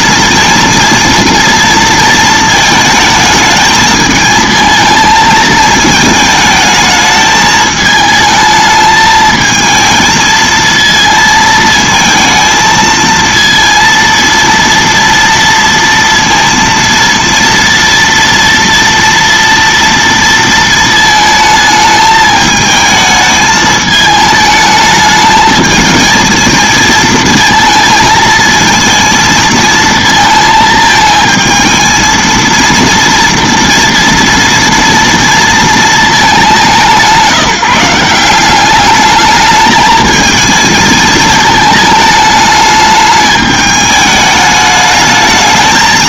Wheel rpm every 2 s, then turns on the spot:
230, 220, 220, 220, 220, 230, 220, 230, 230, 230, 220, 220, 210, 220, 230, 220, 230, 230, 170, 200, 220, 210, 210.
none